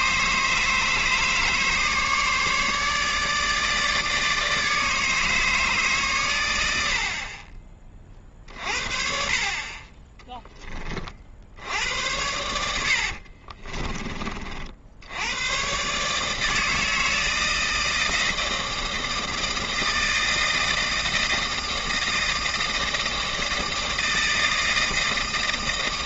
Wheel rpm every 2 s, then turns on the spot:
150, 150, 160, 90, 40, 30, 80, 60, 160, 160, 160, 160, 160.
12-14